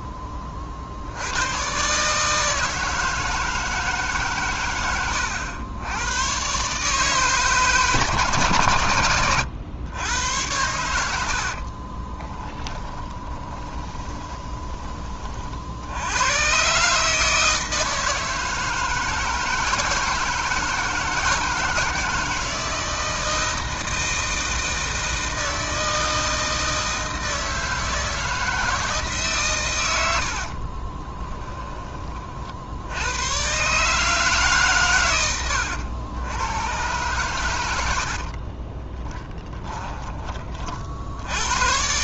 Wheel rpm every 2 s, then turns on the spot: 40, 160, 110, 140, 120, 80, 20, 20, 140, 160, 160, 160, 160, 160, 160, 30, 80, 120, 120, 20, 60.
4-6 10-14 30-32 38-40